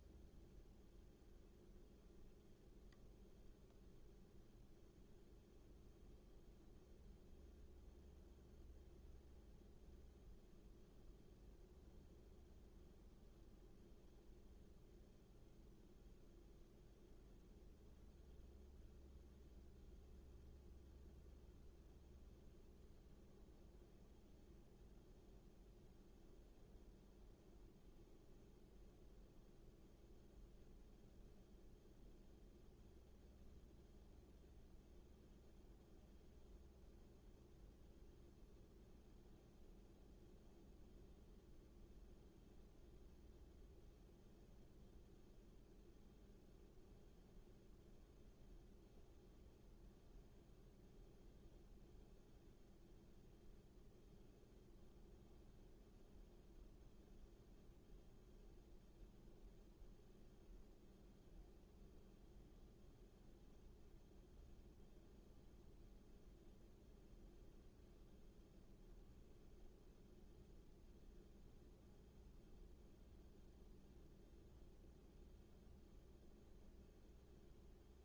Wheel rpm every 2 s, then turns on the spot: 0, 0, 0, 0, 0, 0, 0, 0, 0, 0, 0, 0, 0, 0, 0, 0, 0, 0, 0, 0, 0, 0, 0, 0, 0, 0, 0, 0, 0, 0, 0, 0, 0, 0, 0, 0, 0, 0, 0.
none